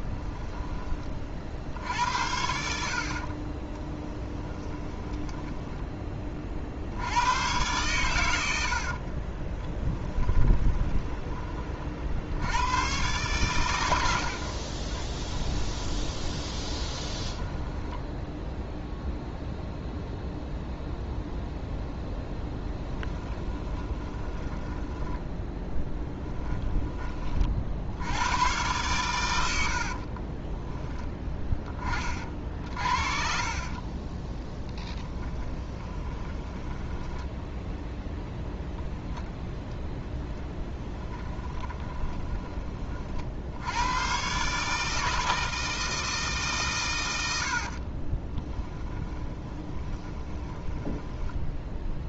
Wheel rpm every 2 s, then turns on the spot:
20, 70, 10, 40, 70, 20, 110, 50, 20, 0, 0, 10, 10, 10, 100, 20, 50, 10, 10, 0, 10, 30, 150, 130, 20, 10.
4-6 8-12 14-18 22-26 34-38 48-52